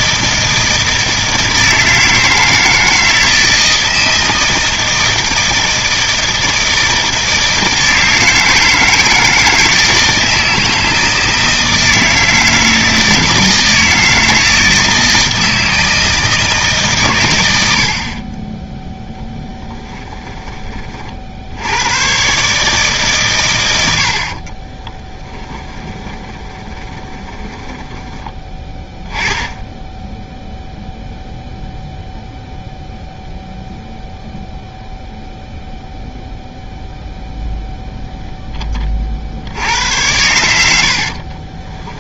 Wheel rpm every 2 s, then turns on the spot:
160, 160, 160, 160, 160, 160, 160, 160, 140, 10, 30, 140, 20, 20, 10, 0, 0, 0, 0, 20, 70.
24-28 40-42